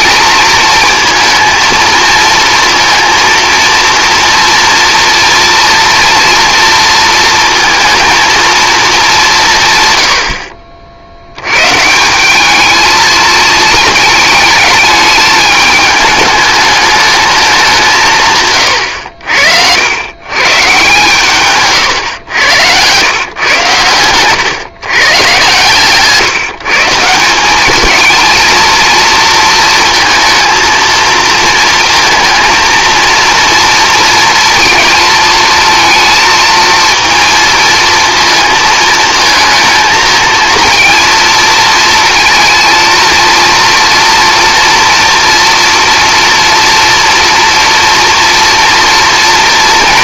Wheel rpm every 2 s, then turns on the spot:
230, 230, 230, 230, 210, 40, 220, 210, 210, 90, 140, 110, 140, 160, 230, 230, 230, 220, 230, 230, 230, 230, 230, 230, 230.
none